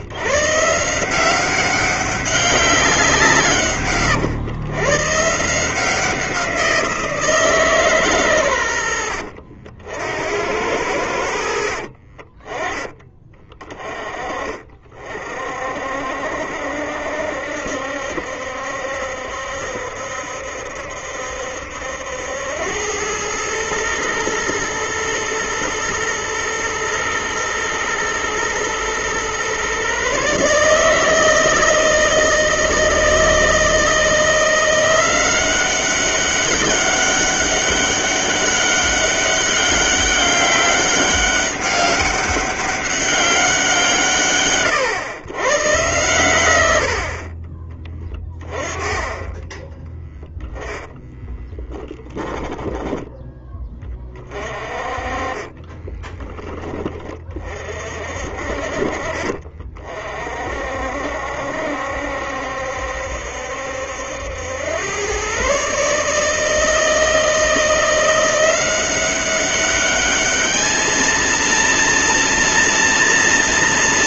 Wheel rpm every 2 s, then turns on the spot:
160, 180, 140, 170, 90, 80, 20, 40, 70, 70, 70, 100, 110, 120, 120, 150, 160, 180, 200, 200, 200, 200, 120, 60, 20, 10, 10, 40, 30, 40, 60, 70, 110, 160, 180, 220, 230.
50-56